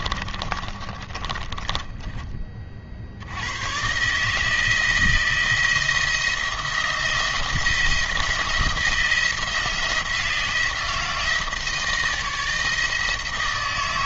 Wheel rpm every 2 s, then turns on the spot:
20, 40, 160, 170, 170, 170, 160.
0-2